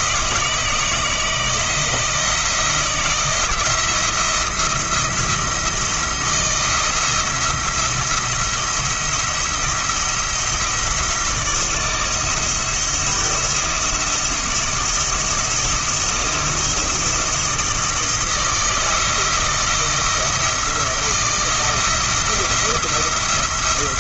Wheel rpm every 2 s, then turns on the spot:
160, 170, 170, 170, 170, 170, 170, 170, 170, 170, 170, 170.
none